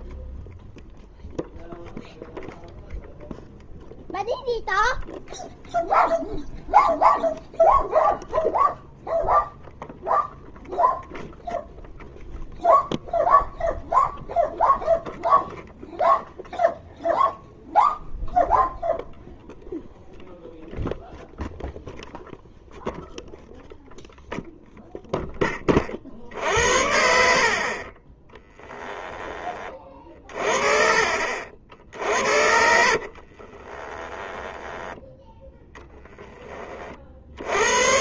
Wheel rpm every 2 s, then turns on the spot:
0, 0, 0, 0, 0, 0, 0, 0, 0, 0, 0, 0, 20, 40, 20, 50, 50, 10, 60.
32-34